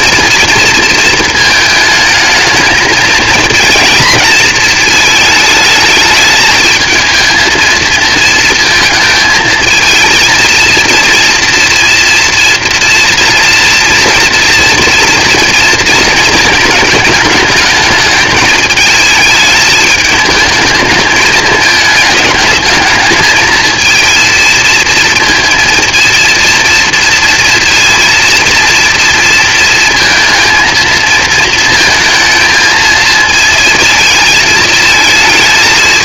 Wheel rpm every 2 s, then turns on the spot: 230, 220, 220, 220, 230, 230, 230, 230, 230, 220, 220, 210, 230, 230, 230, 230, 220, 220.
none